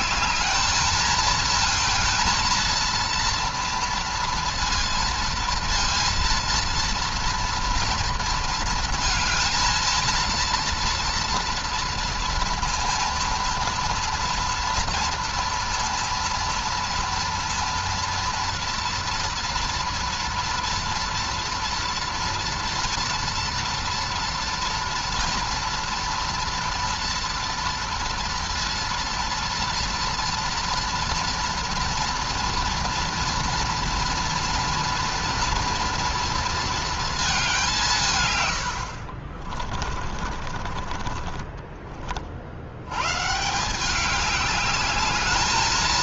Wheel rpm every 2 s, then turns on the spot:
210, 230, 230, 230, 230, 230, 230, 230, 230, 230, 230, 230, 230, 230, 230, 230, 230, 240, 230, 100, 40, 60, 200.
40-42